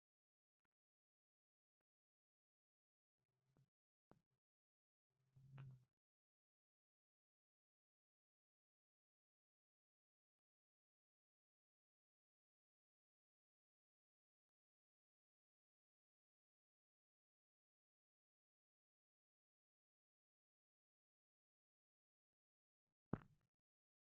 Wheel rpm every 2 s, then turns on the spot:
0, 0, 0, 0, 0, 0, 0, 0, 0, 0, 0, 0.
none